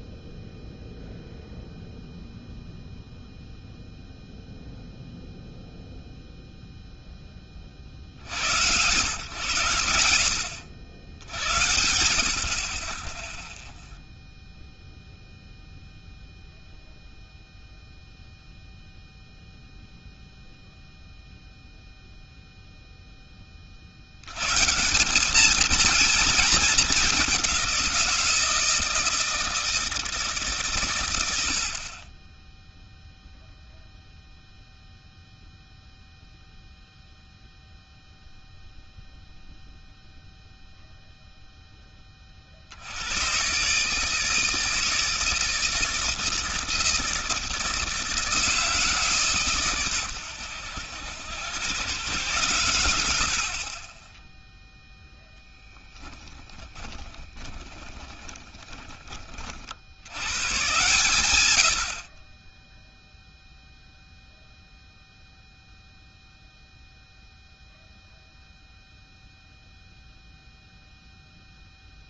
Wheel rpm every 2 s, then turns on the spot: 0, 0, 0, 0, 120, 70, 40, 0, 0, 0, 0, 0, 140, 220, 170, 140, 10, 0, 0, 0, 0, 50, 160, 160, 160, 100, 110, 0, 20, 10, 110, 20, 0, 0, 0, 0.
56-60